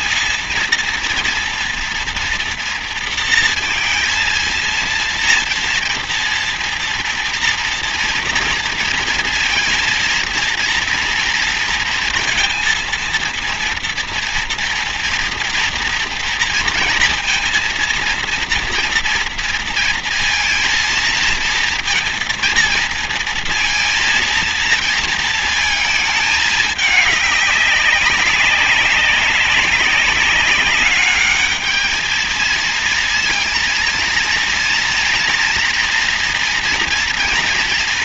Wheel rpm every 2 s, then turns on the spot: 230, 240, 230, 230, 240, 230, 230, 230, 230, 230, 230, 230, 230, 210, 200, 200, 220, 230, 230.
none